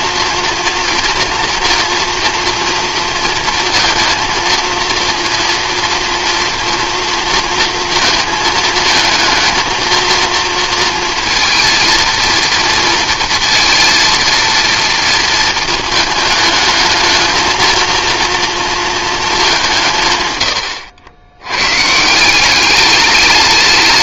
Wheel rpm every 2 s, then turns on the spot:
230, 230, 230, 240, 220, 230, 230, 230, 220, 230, 100, 200.
none